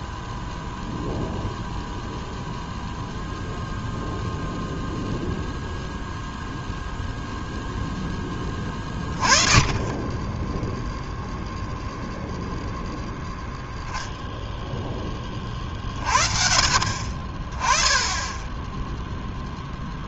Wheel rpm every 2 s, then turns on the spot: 0, 0, 0, 0, 10, 10, 0, 0, 50, 10.
none